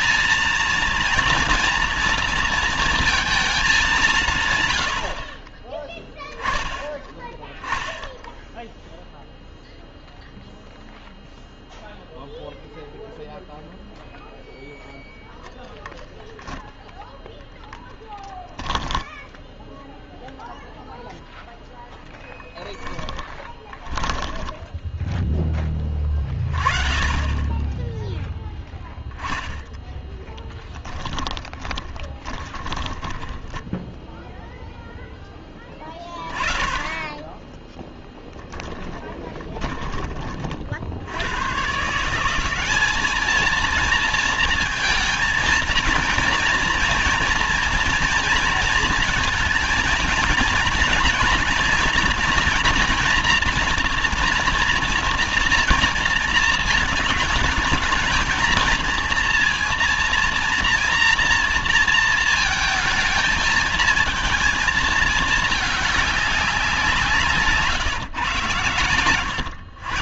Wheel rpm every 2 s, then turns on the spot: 230, 230, 150, 10, 0, 0, 0, 0, 10, 10, 0, 10, 20, 20, 0, 10, 10, 0, 20, 10, 40, 190, 230, 230, 230, 230, 230, 240, 230, 220, 230, 230, 220, 190, 130.
24-26 30-34 38-40